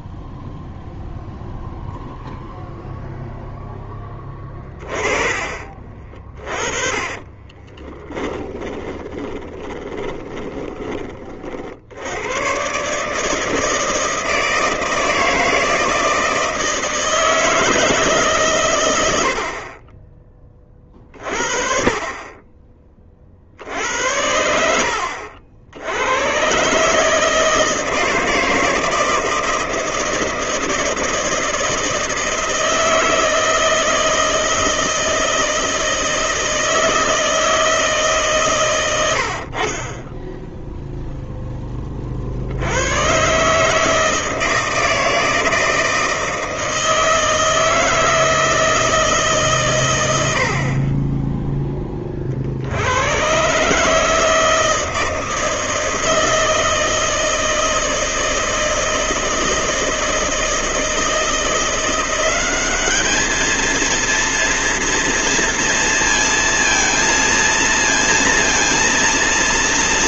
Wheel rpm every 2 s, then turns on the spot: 0, 0, 30, 30, 20, 20, 130, 160, 160, 120, 30, 30, 80, 140, 160, 160, 160, 160, 160, 110, 0, 110, 160, 160, 160, 30, 80, 160, 160, 160, 160, 200, 230, 230, 230.
6-10